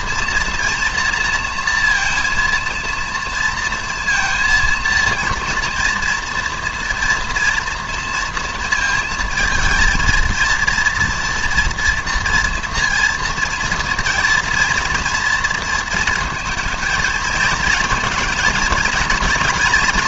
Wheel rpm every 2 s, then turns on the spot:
230, 230, 230, 230, 230, 230, 230, 230, 220, 230.
none